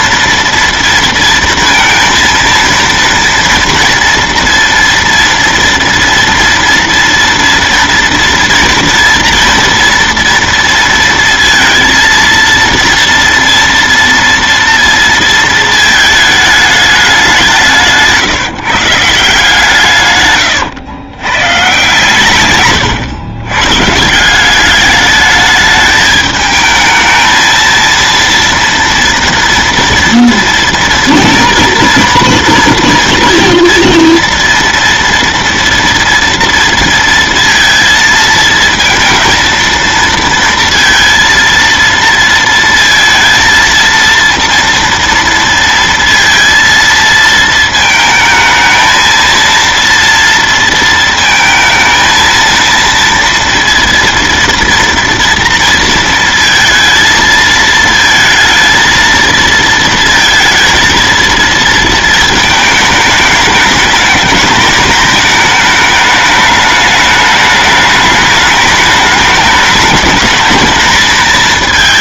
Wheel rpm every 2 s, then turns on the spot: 230, 230, 230, 230, 230, 230, 230, 230, 210, 150, 110, 130, 190, 220, 230, 230, 230, 230, 230, 220, 230, 230, 230, 230, 220, 230, 230, 230, 230, 220, 230, 220, 210, 210, 210, 220.
20-24